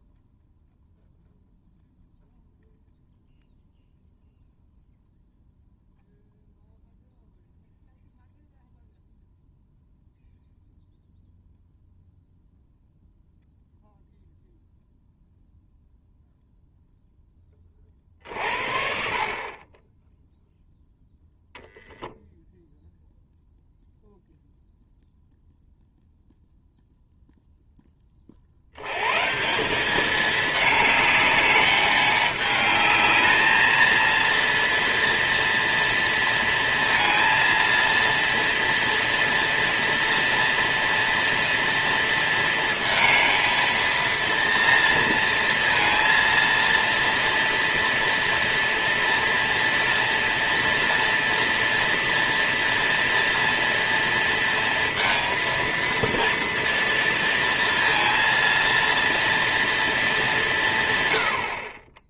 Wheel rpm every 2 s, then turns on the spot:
0, 0, 0, 0, 0, 0, 0, 0, 0, 50, 0, 0, 0, 0, 110, 210, 210, 230, 230, 230, 240, 230, 230, 230, 240, 230, 230, 230, 230, 230, 150.
none